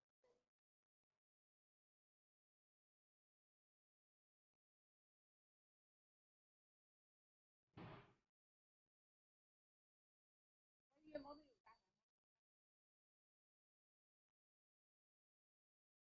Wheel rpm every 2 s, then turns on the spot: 0, 0, 0, 0, 0, 0, 0, 0.
none